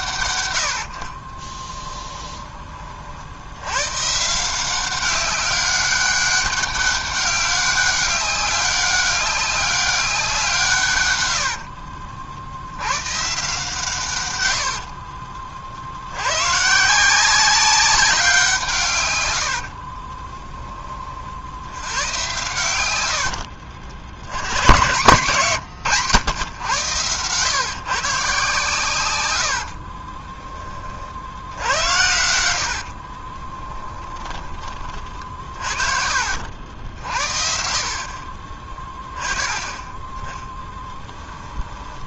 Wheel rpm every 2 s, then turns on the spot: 60, 40, 190, 200, 200, 130, 110, 60, 160, 140, 20, 90, 130, 110, 120, 40, 50, 30, 60, 20, 10.
0-2 28-30 32-36 38-40